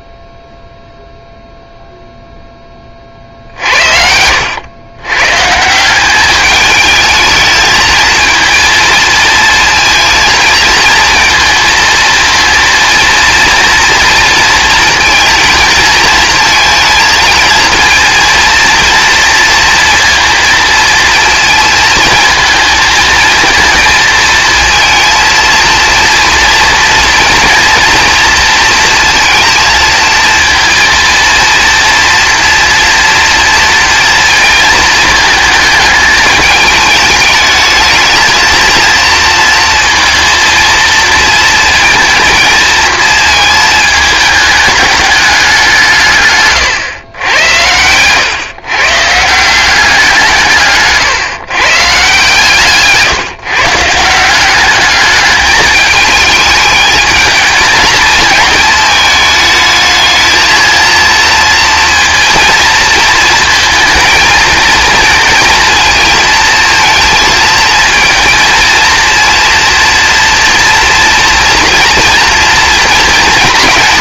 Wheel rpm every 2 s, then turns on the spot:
0, 20, 100, 210, 220, 230, 230, 230, 230, 230, 230, 220, 230, 230, 230, 230, 240, 220, 210, 230, 230, 230, 210, 120, 140, 150, 160, 200, 210, 220, 230, 230, 220, 230, 220, 230, 230.
none